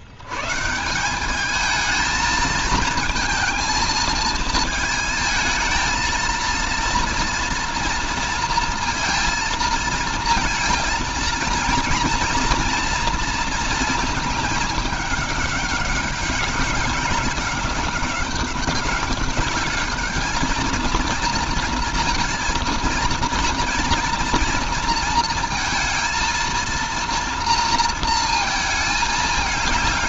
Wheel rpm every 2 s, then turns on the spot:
130, 220, 220, 230, 230, 230, 240, 220, 200, 190, 220, 230, 230, 230, 230.
none